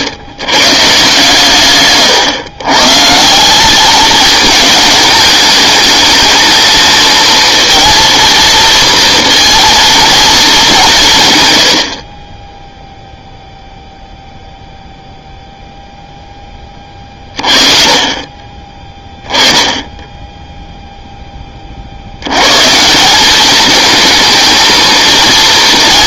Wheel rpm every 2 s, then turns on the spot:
120, 120, 220, 220, 240, 200, 10, 0, 20, 20, 0, 150, 220.
none